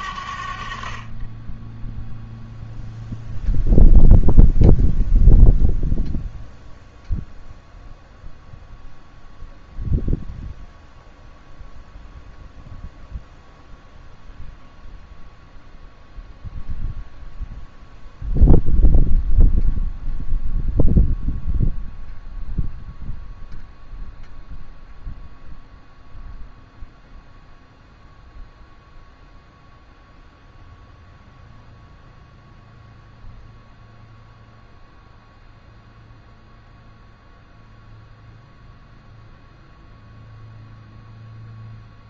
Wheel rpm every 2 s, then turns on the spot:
50, 0, 0, 0, 0, 0, 0, 0, 0, 0, 0, 0, 0, 0, 0, 0, 0, 0, 0, 0, 0.
none